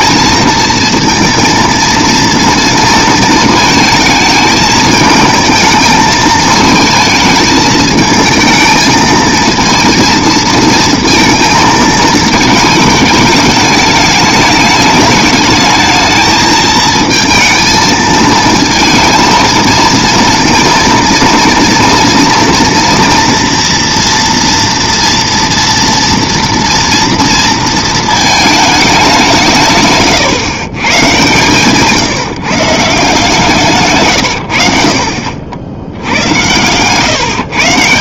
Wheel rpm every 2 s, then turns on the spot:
230, 230, 220, 220, 220, 230, 210, 210, 220, 230, 230, 230, 230, 230, 210, 130, 150, 80, 110.
none